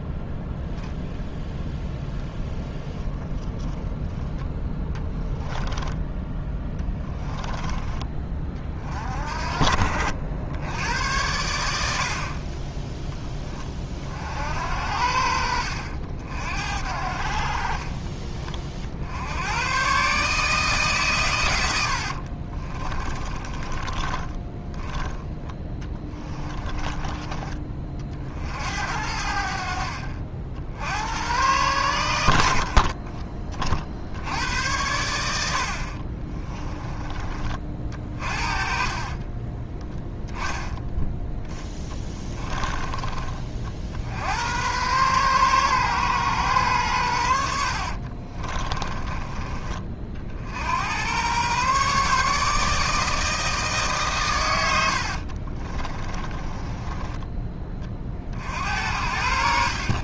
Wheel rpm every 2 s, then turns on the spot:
0, 0, 10, 20, 40, 90, 10, 80, 60, 70, 150, 30, 20, 20, 70, 80, 40, 90, 20, 40, 10, 20, 120, 100, 20, 90, 160, 80, 20, 70.
4-8 22-26 32-34 38-40 48-50 54-58